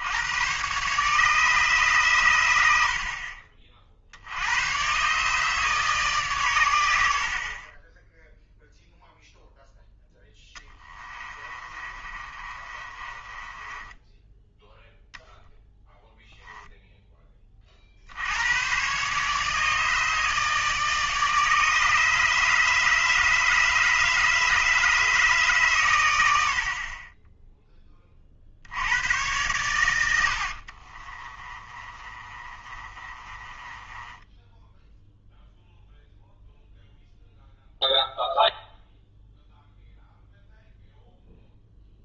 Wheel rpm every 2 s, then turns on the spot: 130, 80, 100, 100, 0, 10, 30, 10, 0, 120, 150, 160, 160, 50, 80, 50, 30, 10, 0, 0, 0.
10-14 30-36